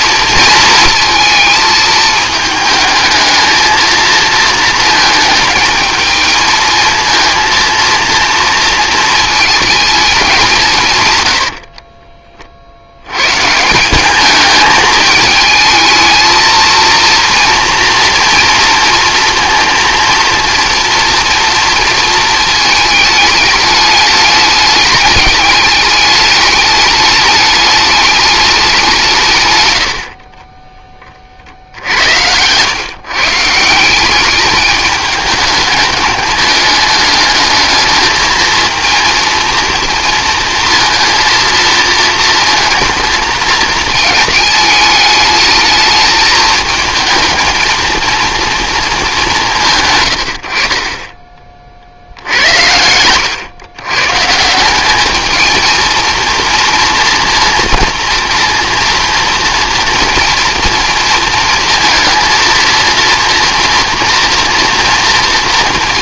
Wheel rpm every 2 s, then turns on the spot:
220, 220, 220, 230, 230, 140, 80, 210, 230, 230, 230, 220, 210, 210, 190, 20, 130, 210, 210, 230, 230, 230, 220, 220, 220, 30, 90, 180, 230, 240, 230, 230, 220.
none